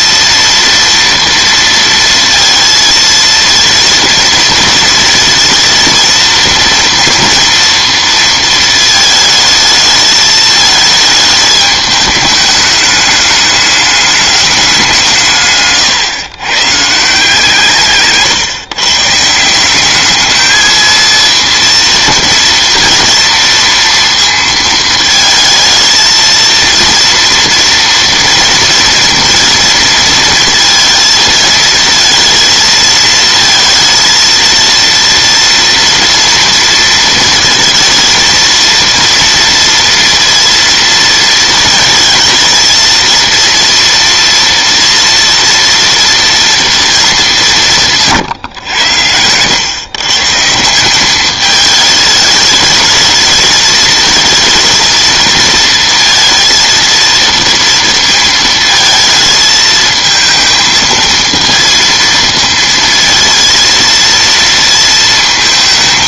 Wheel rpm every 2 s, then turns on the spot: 230, 230, 230, 230, 220, 220, 210, 180, 140, 140, 220, 230, 230, 230, 230, 220, 230, 230, 230, 230, 230, 230, 230, 220, 110, 180, 210, 220, 230, 220, 220, 230, 230.
none